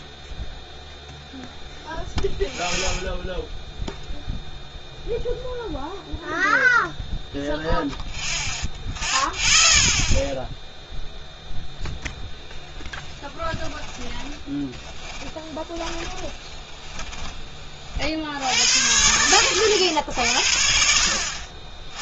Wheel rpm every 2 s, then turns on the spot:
0, 0, 0, 0, 0, 0, 0, 10, 10, 90, 70.
14-18